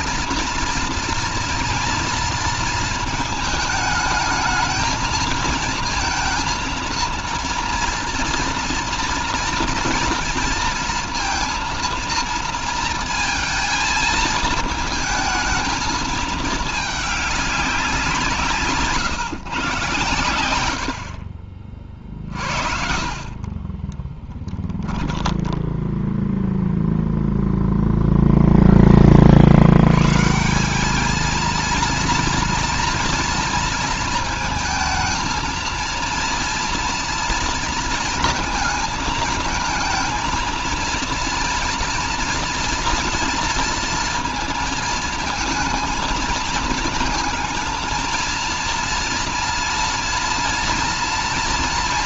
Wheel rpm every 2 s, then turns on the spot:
230, 230, 220, 230, 230, 230, 230, 220, 210, 150, 90, 40, 10, 0, 20, 200, 230, 220, 240, 220, 230, 230, 220, 220, 230, 230.
22-26